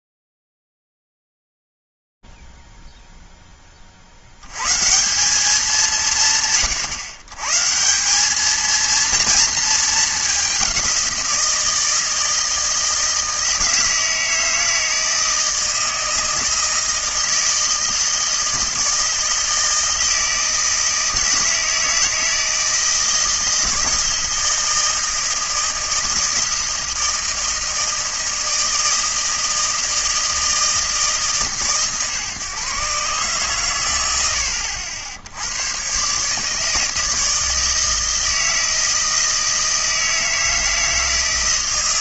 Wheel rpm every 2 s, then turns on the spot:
0, 0, 80, 150, 200, 200, 160, 160, 160, 160, 160, 160, 160, 160, 160, 160, 130, 70, 150, 160, 160.
none